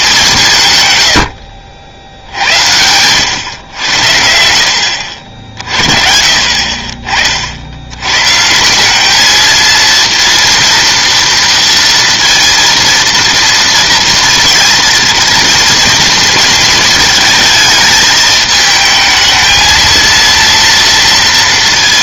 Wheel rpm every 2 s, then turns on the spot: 140, 80, 70, 40, 180, 230, 230, 230, 220, 220, 230.
none